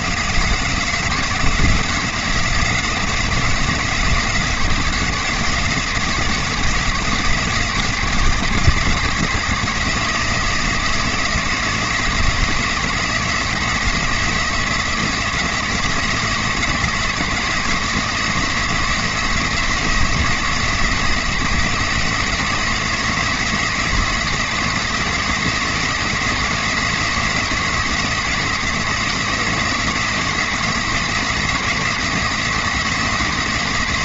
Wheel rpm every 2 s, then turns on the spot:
180, 170, 170, 170, 160, 170, 170, 170, 170, 170, 160, 160, 170, 170, 160, 170, 160.
none